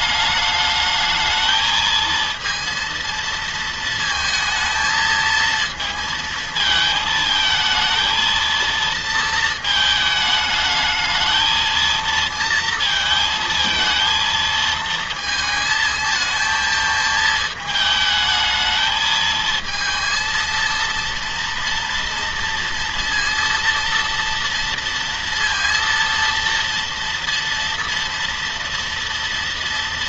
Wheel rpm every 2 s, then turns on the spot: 210, 230, 220, 220, 230, 210, 230, 230, 220, 220, 230, 230, 230, 230, 230.
none